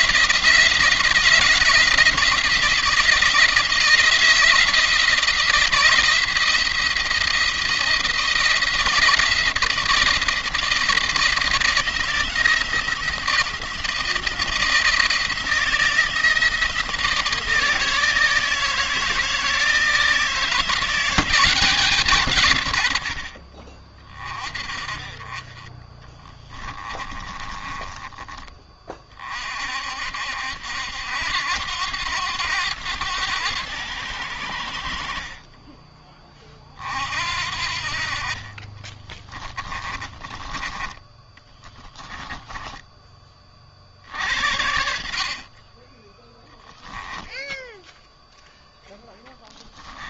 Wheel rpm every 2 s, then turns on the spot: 160, 170, 170, 170, 170, 170, 170, 170, 170, 160, 170, 110, 40, 20, 30, 70, 90, 60, 40, 30, 20, 20, 70, 10, 0.
26-28 38-40 46-48